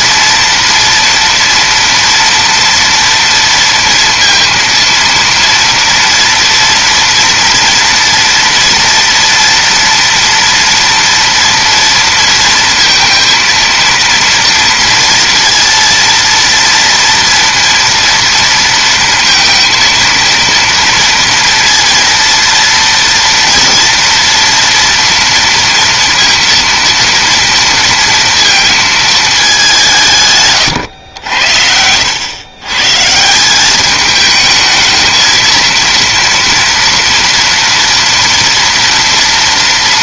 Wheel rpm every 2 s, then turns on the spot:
230, 240, 230, 230, 230, 230, 230, 230, 230, 230, 230, 230, 240, 230, 220, 120, 130, 220, 230, 230.
none